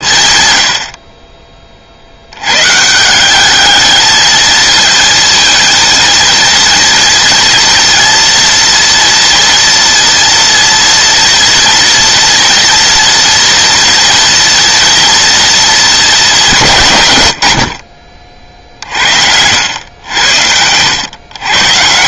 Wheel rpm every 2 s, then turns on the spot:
70, 150, 230, 230, 230, 230, 230, 240, 140, 50, 100.
none